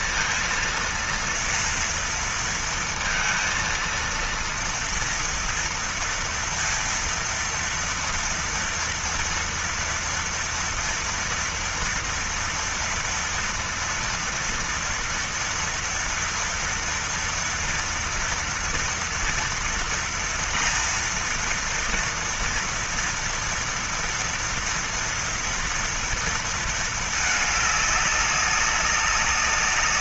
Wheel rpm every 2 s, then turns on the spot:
230, 230, 230, 230, 230, 230, 230, 230, 230, 230, 230, 240, 230, 230, 200.
none